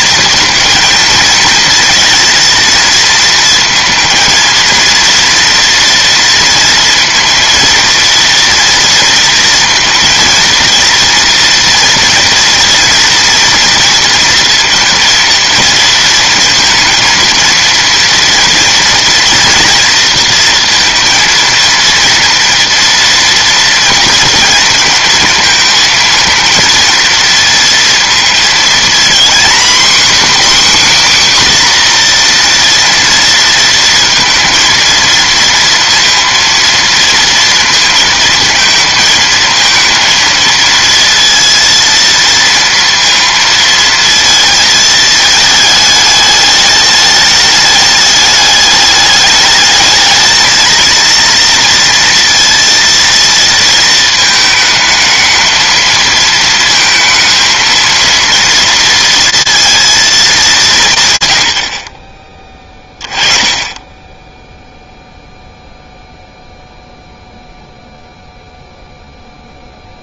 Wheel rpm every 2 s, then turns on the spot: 220, 230, 230, 230, 230, 230, 230, 230, 230, 230, 230, 230, 230, 220, 230, 270, 240, 230, 230, 230, 230, 230, 220, 210, 210, 230, 230, 220, 220, 230, 180, 20, 0, 0, 0.
none